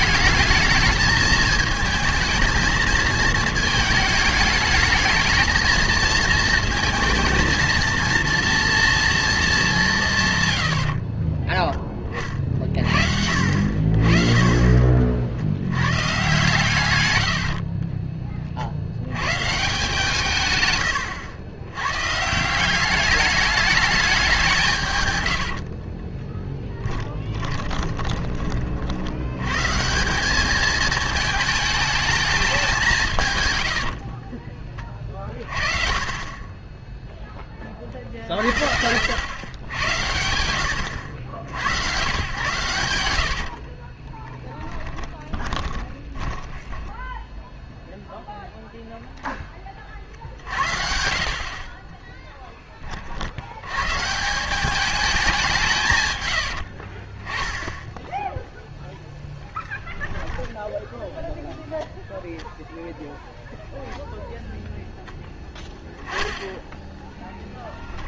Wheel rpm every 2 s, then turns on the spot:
220, 220, 220, 230, 230, 40, 50, 50, 110, 50, 130, 190, 140, 10, 60, 210, 190, 30, 10, 80, 80, 100, 10, 10, 0, 60, 40, 200, 60, 0, 0, 0, 0, 10.
10-12 26-28 44-46 56-58